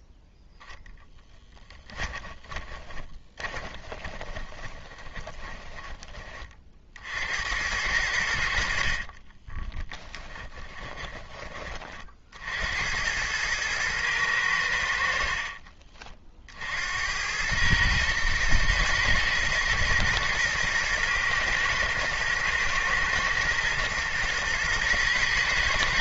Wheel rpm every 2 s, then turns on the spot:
0, 20, 20, 50, 50, 20, 80, 70, 80, 110, 110, 110, 110.
2-6 10-12